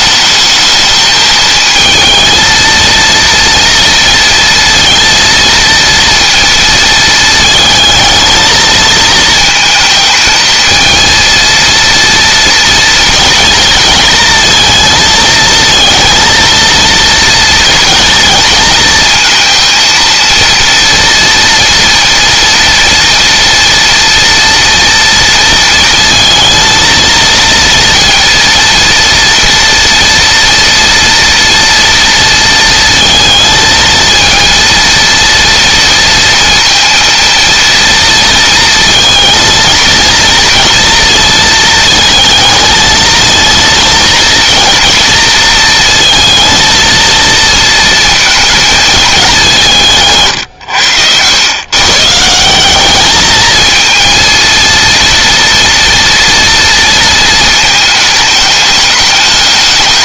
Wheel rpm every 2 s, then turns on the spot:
220, 230, 230, 220, 230, 230, 230, 220, 230, 230, 230, 240, 230, 230, 230, 230, 230, 230, 230, 230, 230, 220, 230, 230, 220, 100, 210, 230, 230, 210.
none